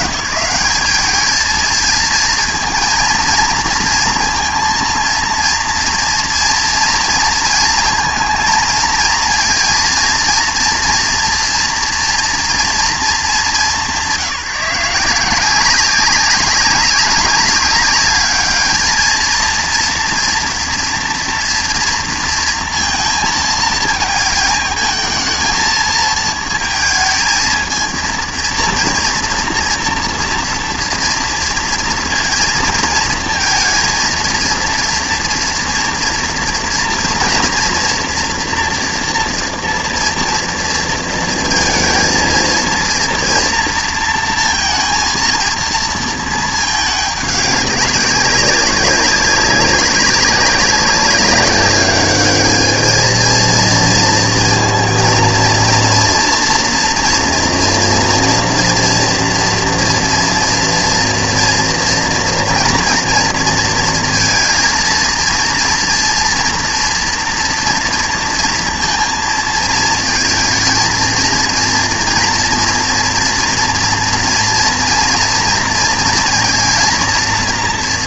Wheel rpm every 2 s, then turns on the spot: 180, 230, 230, 240, 230, 230, 240, 170, 200, 210, 230, 230, 220, 230, 230, 230, 230, 230, 230, 230, 230, 230, 230, 220, 200, 200, 210, 230, 230, 230, 230, 230, 230, 240, 230, 220, 230, 230, 230.
none